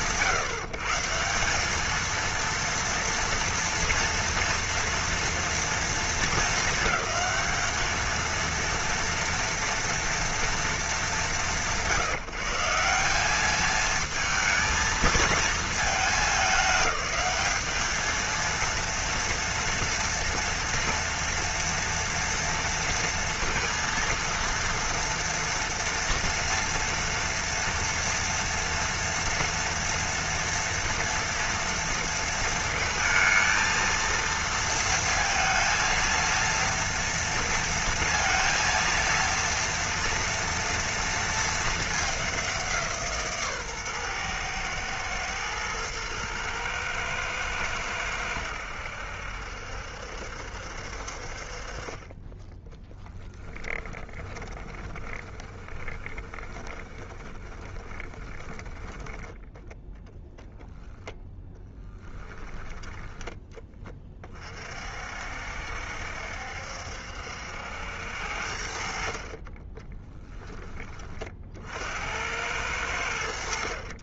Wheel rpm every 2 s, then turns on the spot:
160, 230, 230, 200, 230, 210, 180, 220, 200, 230, 230, 230, 230, 230, 230, 230, 230, 230, 230, 230, 230, 160, 120, 110, 80, 60, 10, 20, 20, 10, 0, 10, 50, 70, 50, 20, 90.
52-60